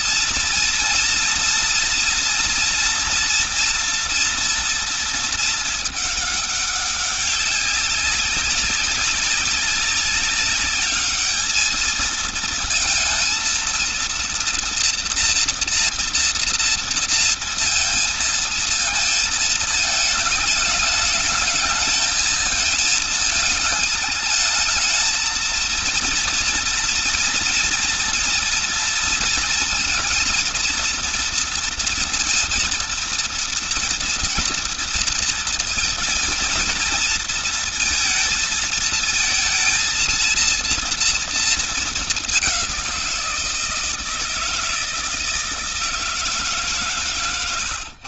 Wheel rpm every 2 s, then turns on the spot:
230, 240, 230, 200, 200, 200, 220, 230, 230, 230, 210, 220, 220, 240, 230, 230, 230, 230, 230, 220, 230, 190, 160, 150.
none